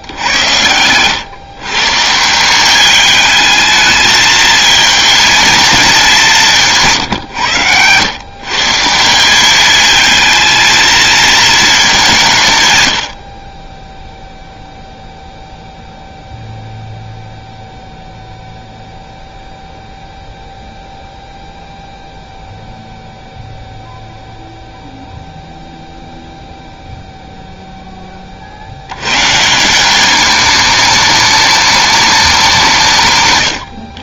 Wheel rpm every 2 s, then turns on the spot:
70, 170, 220, 190, 130, 220, 160, 0, 0, 0, 0, 0, 0, 0, 40, 200, 190.
none